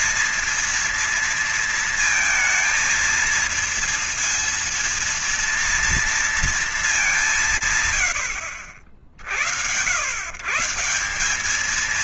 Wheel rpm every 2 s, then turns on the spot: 230, 230, 230, 170, 80, 200.
none